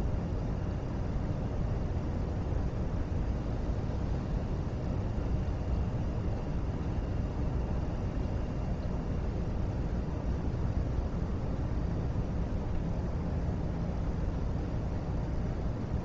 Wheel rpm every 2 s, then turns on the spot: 0, 0, 0, 0, 0, 0, 0, 0.
none